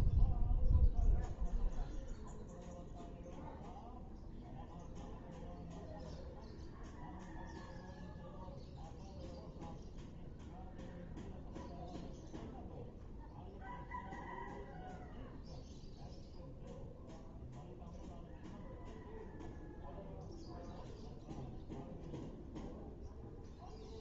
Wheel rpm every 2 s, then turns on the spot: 0, 0, 0, 0, 0, 0, 0, 0, 0, 0, 0, 0.
none